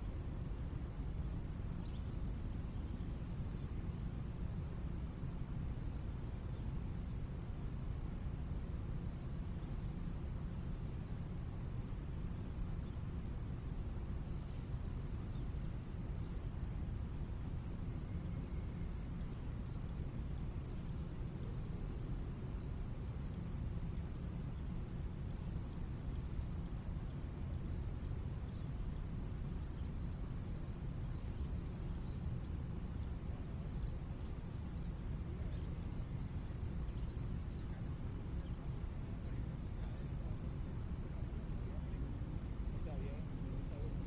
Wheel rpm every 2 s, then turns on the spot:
0, 0, 0, 0, 0, 0, 0, 0, 0, 0, 0, 0, 0, 0, 0, 0, 0, 0, 0, 0, 0, 0.
none